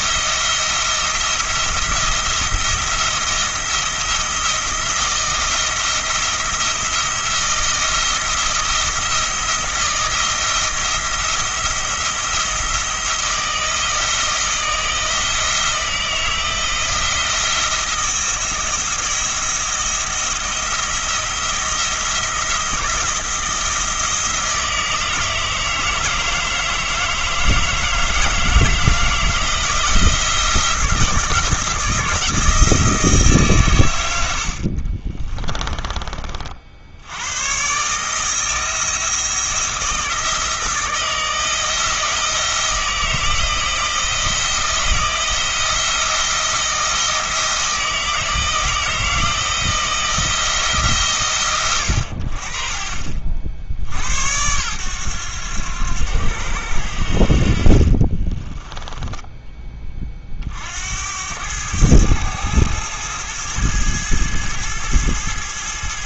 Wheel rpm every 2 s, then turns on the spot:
170, 170, 160, 170, 170, 170, 170, 170, 160, 160, 170, 170, 160, 160, 160, 170, 150, 40, 80, 160, 160, 160, 170, 170, 160, 130, 50, 100, 80, 10, 60, 110, 110.
34-36 58-60